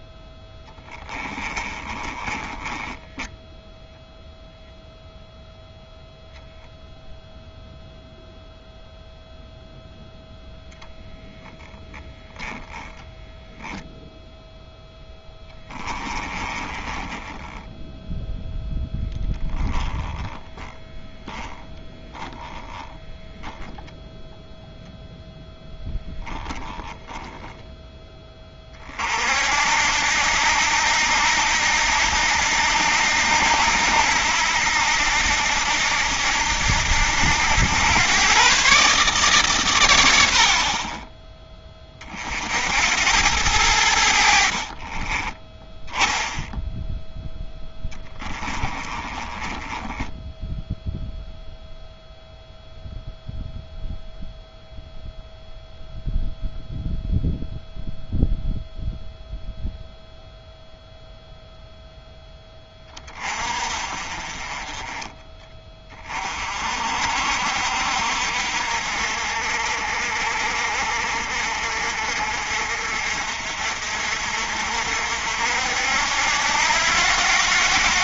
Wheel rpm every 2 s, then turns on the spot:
10, 10, 0, 0, 0, 0, 0, 0, 20, 10, 10, 10, 0, 10, 30, 80, 80, 80, 80, 140, 40, 70, 40, 0, 20, 0, 0, 0, 0, 0, 0, 20, 20, 50, 60, 50, 60, 60, 80.
0-4 16-18 20-24 44-46 48-50